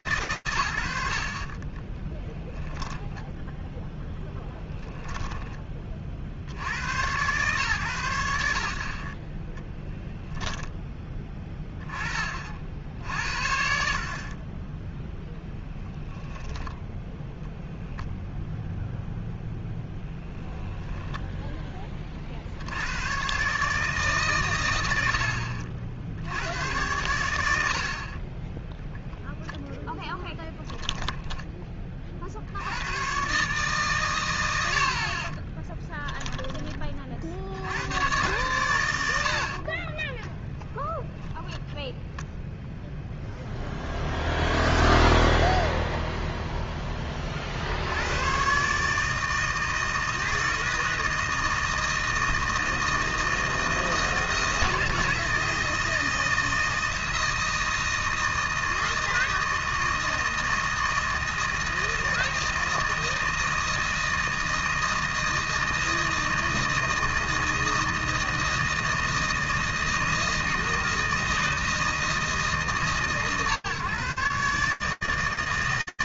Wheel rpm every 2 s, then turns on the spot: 70, 0, 10, 100, 50, 10, 60, 10, 0, 0, 10, 80, 110, 110, 10, 10, 80, 80, 20, 110, 0, 0, 0, 0, 110, 160, 160, 160, 170, 160, 160, 160, 160, 160, 160, 160, 160, 140.
4-6